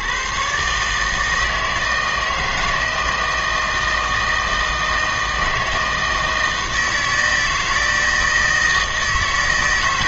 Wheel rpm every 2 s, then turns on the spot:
150, 160, 160, 160, 160.
none